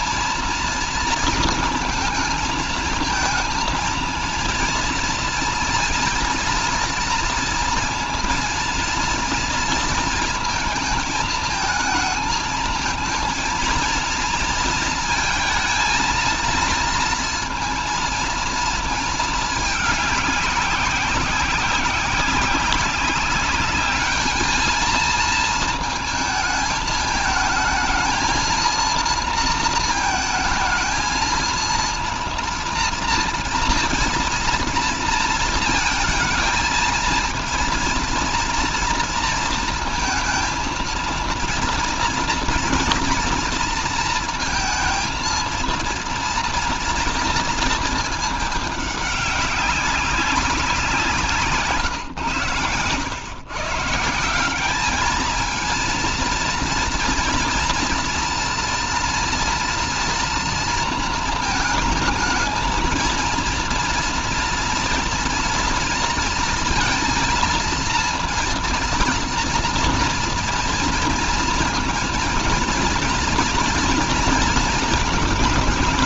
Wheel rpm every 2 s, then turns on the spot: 230, 220, 230, 230, 230, 220, 220, 230, 230, 220, 190, 200, 220, 220, 230, 220, 230, 230, 220, 230, 230, 230, 230, 230, 200, 180, 110, 210, 230, 230, 230, 220, 230, 230, 230, 230, 230, 230.
none